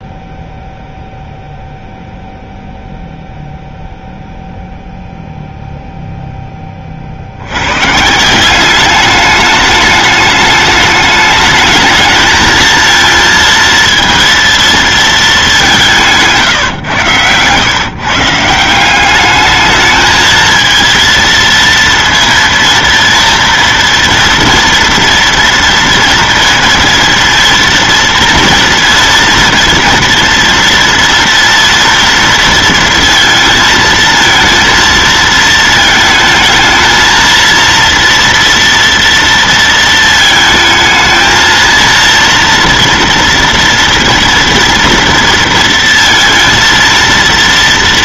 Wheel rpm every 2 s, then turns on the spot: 0, 0, 0, 30, 190, 210, 230, 230, 140, 180, 230, 230, 240, 230, 230, 230, 230, 230, 220, 230, 220, 230, 230, 230.
16-18